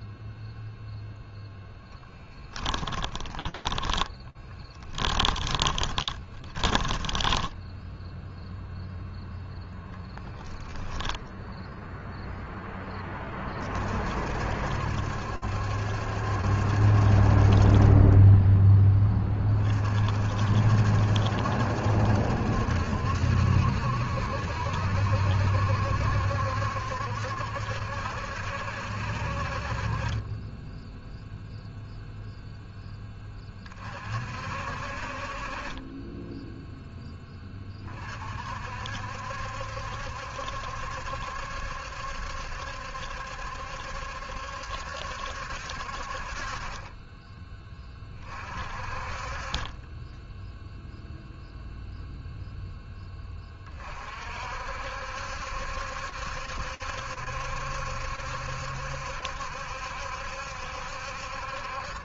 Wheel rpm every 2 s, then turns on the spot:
0, 10, 10, 10, 0, 0, 30, 70, 40, 30, 70, 70, 70, 70, 50, 0, 30, 40, 20, 70, 70, 70, 70, 10, 40, 0, 10, 70, 70, 70, 50.
2-8